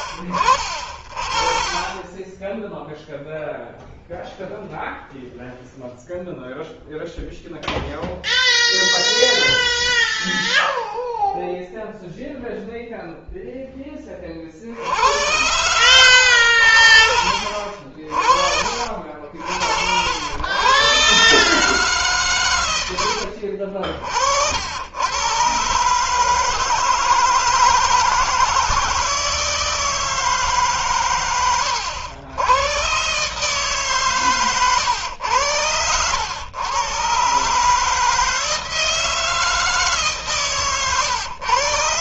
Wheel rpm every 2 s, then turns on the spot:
50, 10, 0, 0, 0, 0, 0, 40, 80, 50, 90, 110, 70, 150, 160, 150, 90, 140, 100, 160, 150.
none